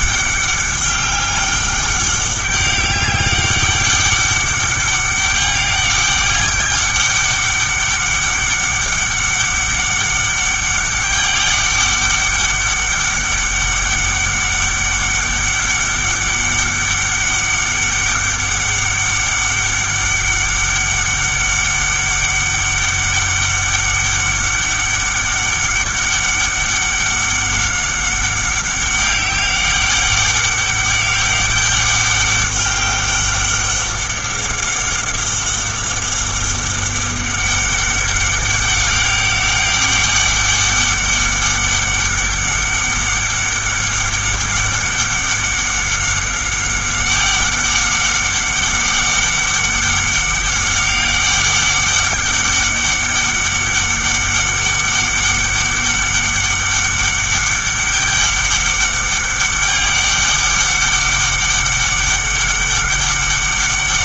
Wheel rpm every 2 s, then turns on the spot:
200, 200, 200, 200, 200, 200, 200, 200, 200, 200, 200, 200, 200, 200, 190, 200, 200, 200, 200, 190, 200, 200, 200, 200, 190, 200, 200, 200, 200, 200, 200, 200.
none